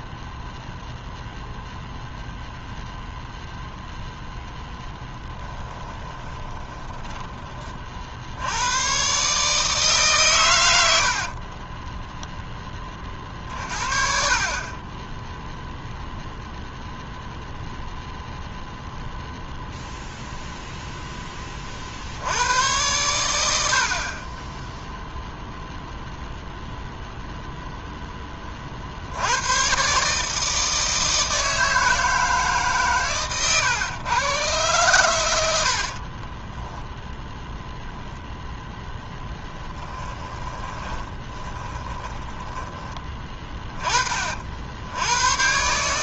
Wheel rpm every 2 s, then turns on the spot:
0, 0, 10, 10, 110, 80, 30, 20, 0, 0, 0, 100, 0, 0, 60, 160, 130, 110, 10, 10, 20, 20, 90.
4-8 10-12 36-38 40-42